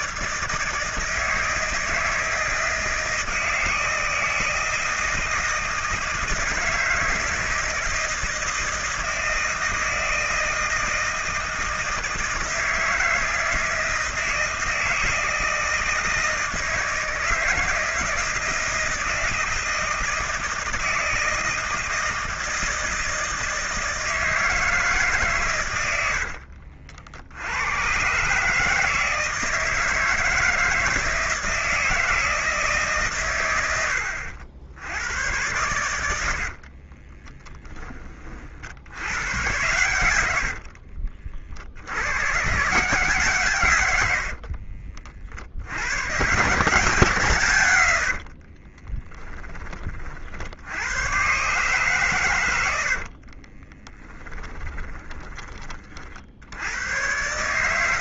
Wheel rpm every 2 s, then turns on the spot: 160, 160, 160, 160, 160, 160, 160, 160, 160, 160, 160, 160, 160, 60, 150, 160, 150, 90, 50, 70, 60, 140, 50, 140, 30, 70, 100, 10, 80.
26-28 36-38 40-42 44-46 48-50 52-56